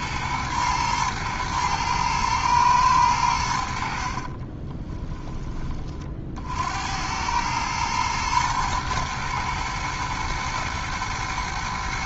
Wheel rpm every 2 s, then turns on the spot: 110, 110, 20, 70, 110, 120.
4-6